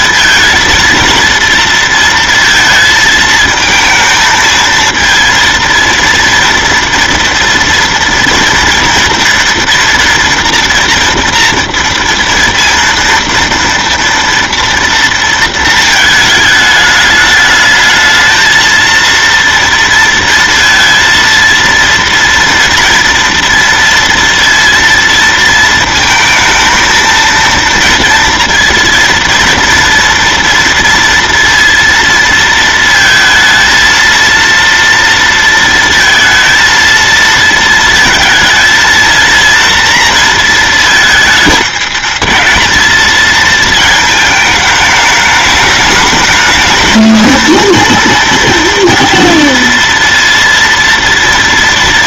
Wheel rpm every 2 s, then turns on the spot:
230, 230, 220, 230, 230, 230, 230, 230, 210, 230, 230, 230, 230, 230, 230, 230, 230, 230, 230, 230, 230, 220, 210, 220, 230, 230.
none